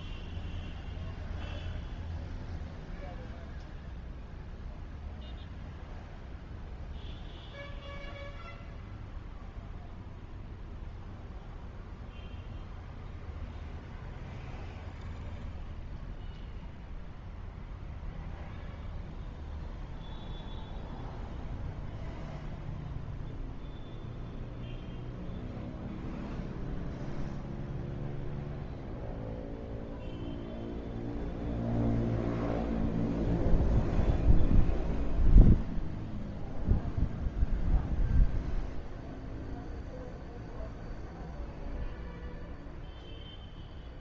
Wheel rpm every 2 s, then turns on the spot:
0, 0, 0, 0, 0, 0, 0, 0, 0, 0, 0, 0, 0, 0, 0, 0, 0, 0, 0, 0, 0, 0.
none